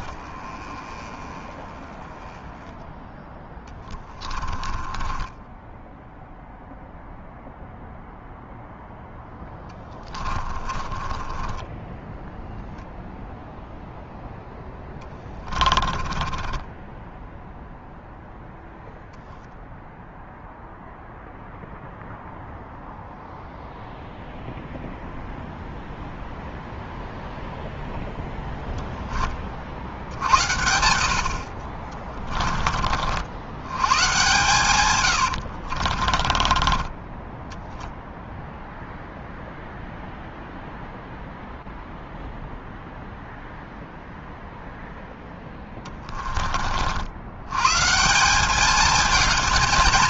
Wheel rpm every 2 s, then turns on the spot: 20, 0, 20, 0, 0, 20, 0, 0, 10, 10, 0, 0, 0, 0, 0, 70, 20, 130, 20, 0, 0, 0, 0, 30, 180.
0-2 4-6 10-12 16-18 32-34 36-38